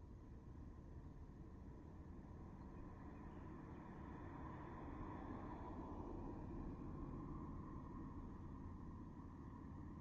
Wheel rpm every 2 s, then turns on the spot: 0, 0, 0, 0, 0.
none